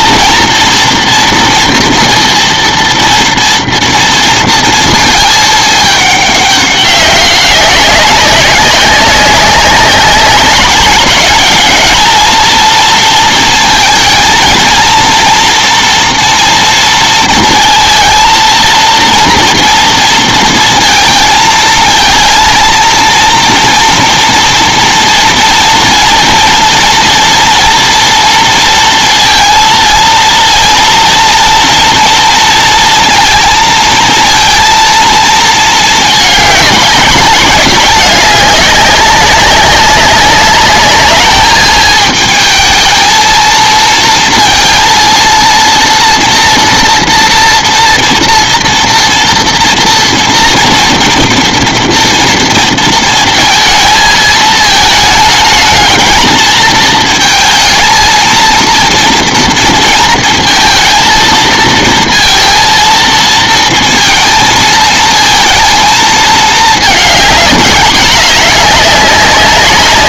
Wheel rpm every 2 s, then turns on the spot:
230, 230, 230, 200, 200, 200, 230, 220, 230, 230, 230, 230, 240, 230, 230, 230, 230, 230, 210, 200, 200, 220, 230, 230, 230, 230, 230, 220, 220, 230, 230, 230, 220, 220, 210.
none